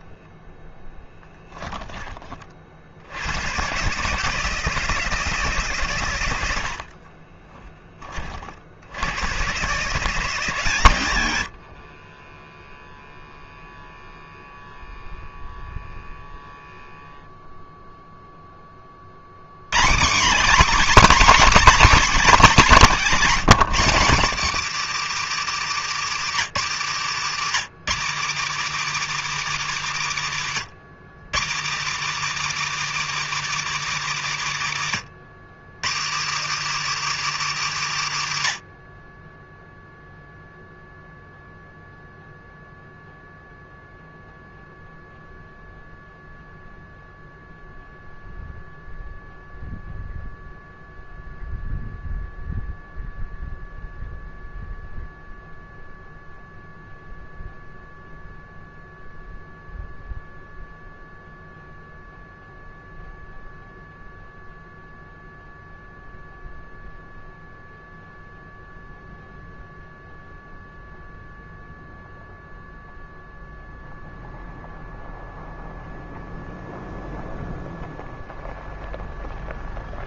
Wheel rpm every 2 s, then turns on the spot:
10, 50, 150, 60, 70, 130, 10, 0, 0, 20, 240, 260, 290, 260, 290, 200, 300, 230, 300, 120, 0, 0, 0, 0, 0, 0, 0, 0, 0, 0, 0, 0, 0, 0, 0, 0, 0, 0, 0, 0.
0-2 6-8